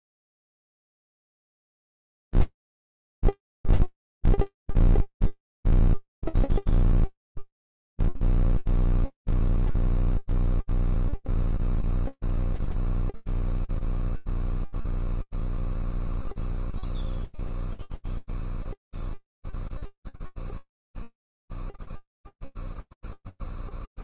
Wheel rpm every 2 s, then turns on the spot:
0, 0, 0, 0, 0, 0, 0, 0, 0, 0, 0, 0.
none